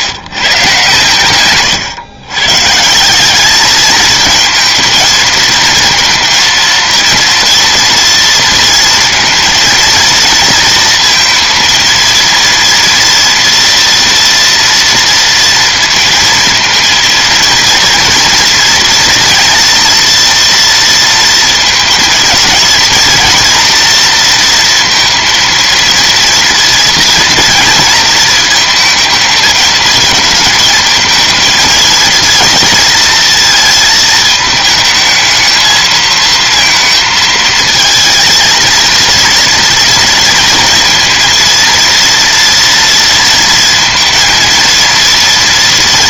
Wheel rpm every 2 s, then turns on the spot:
140, 150, 230, 230, 230, 230, 230, 230, 230, 230, 230, 230, 230, 230, 220, 230, 230, 220, 230, 230, 230, 230, 230.
none